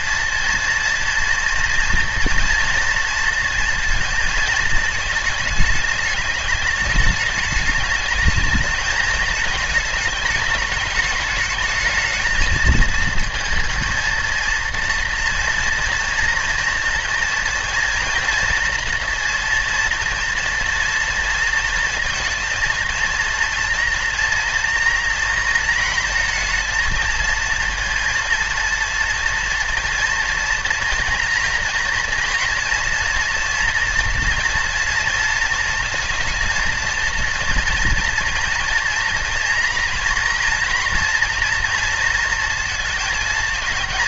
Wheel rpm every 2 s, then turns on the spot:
230, 230, 220, 210, 220, 210, 220, 230, 230, 230, 230, 230, 230, 230, 230, 230, 230, 230, 230, 240, 230, 220.
none